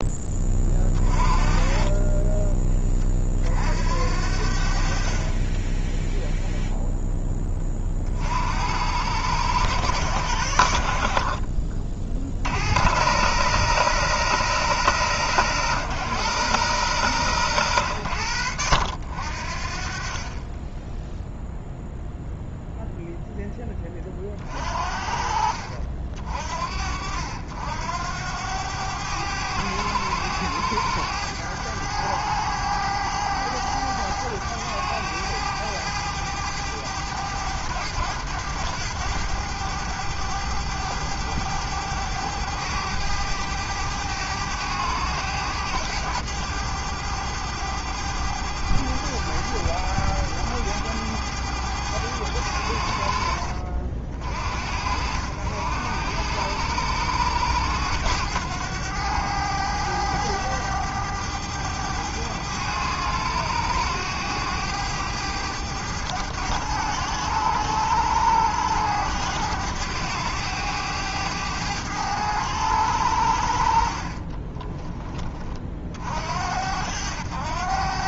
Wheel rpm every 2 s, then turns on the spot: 20, 20, 60, 0, 70, 70, 70, 120, 110, 70, 20, 0, 40, 50, 90, 100, 100, 100, 100, 100, 100, 100, 100, 100, 100, 100, 80, 60, 90, 100, 100, 100, 100, 100, 100, 100, 100, 20, 70.
none